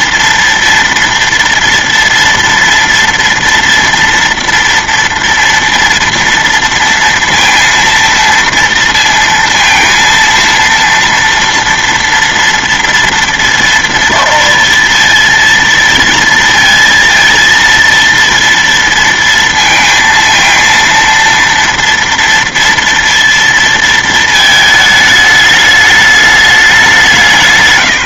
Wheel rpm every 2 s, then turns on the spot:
230, 230, 230, 230, 230, 230, 230, 230, 230, 230, 230, 230, 220, 200.
none